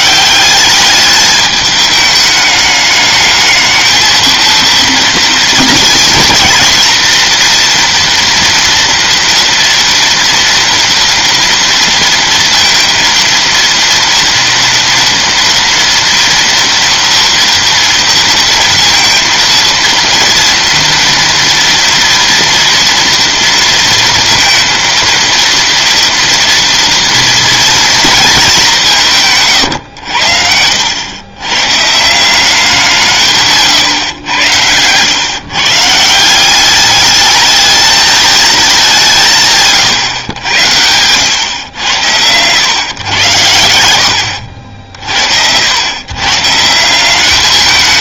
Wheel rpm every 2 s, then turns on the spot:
210, 210, 230, 230, 230, 240, 230, 230, 230, 230, 230, 240, 230, 230, 180, 100, 160, 110, 210, 190, 90, 120, 50, 170.
none